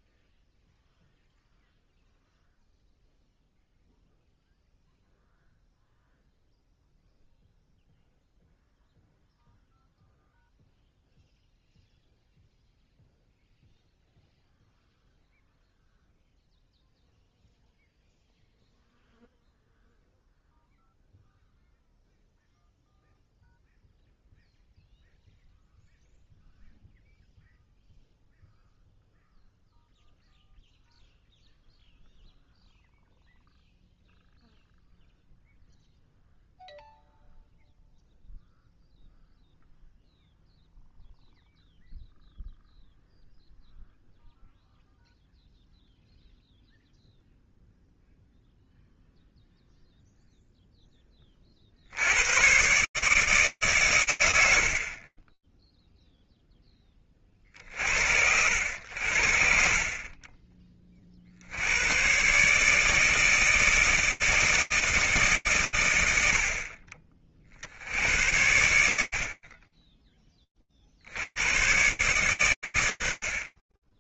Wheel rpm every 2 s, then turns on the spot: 0, 0, 0, 0, 0, 0, 0, 0, 0, 0, 0, 0, 0, 0, 0, 0, 0, 0, 0, 0, 0, 0, 0, 0, 0, 0, 80, 120, 0, 80, 30, 130, 160, 70, 80, 20, 130.
none